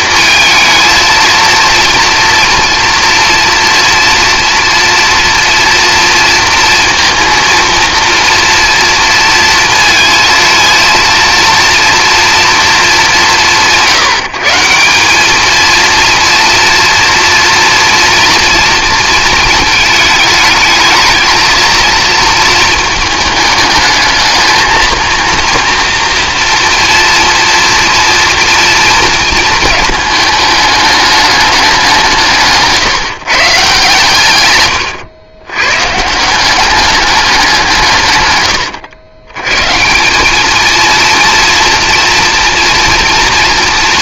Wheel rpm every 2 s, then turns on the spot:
230, 230, 230, 230, 230, 230, 220, 170, 230, 230, 220, 220, 220, 230, 230, 210, 150, 120, 190, 120, 230, 230.
34-36